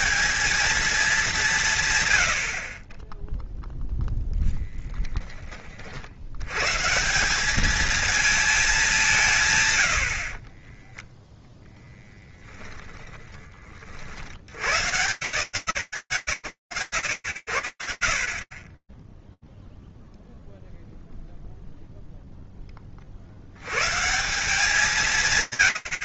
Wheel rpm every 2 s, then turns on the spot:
210, 40, 10, 160, 200, 10, 20, 140, 80, 10, 0, 30, 180.
10-12